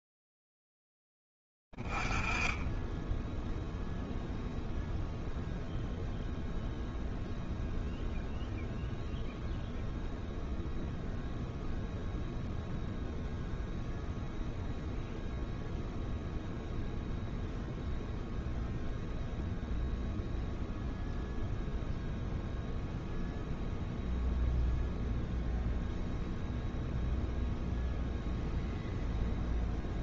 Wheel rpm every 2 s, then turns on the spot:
0, 20, 0, 0, 0, 0, 0, 0, 0, 0, 0, 0, 0, 0, 0.
none